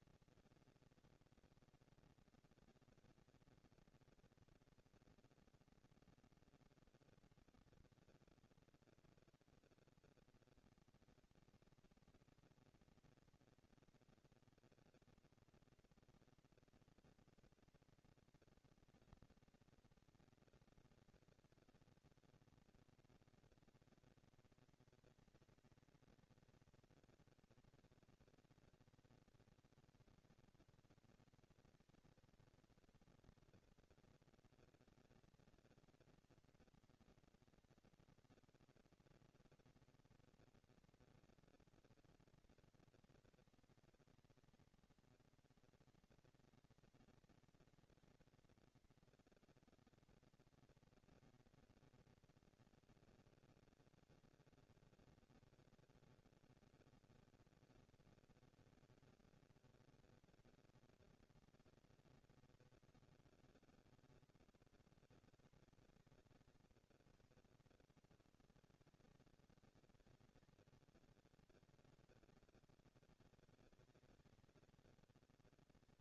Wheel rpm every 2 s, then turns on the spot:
230, 230, 230, 230, 240, 230, 230, 230, 230, 210, 200, 220, 230, 230, 230, 230, 230, 230, 230, 230, 230, 230, 230, 230, 230, 230, 230, 230, 230, 230, 230, 220, 200, 160, 150, 200, 200, 200.
none